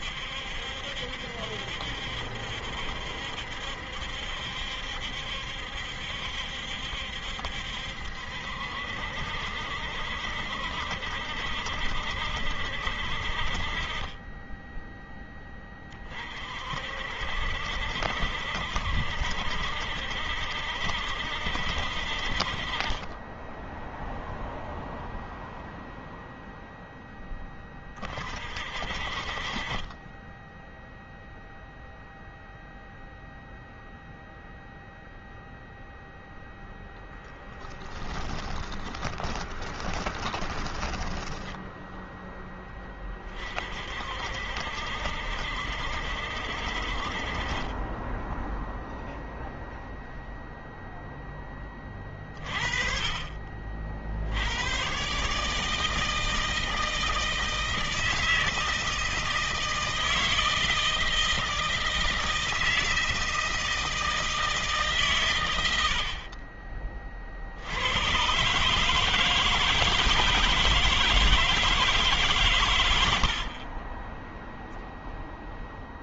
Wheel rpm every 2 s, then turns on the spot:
70, 70, 70, 70, 70, 70, 60, 10, 50, 70, 70, 30, 0, 0, 40, 0, 0, 0, 10, 20, 20, 20, 60, 60, 0, 0, 40, 110, 160, 160, 160, 160, 150, 30, 140, 160, 110, 0.
36-42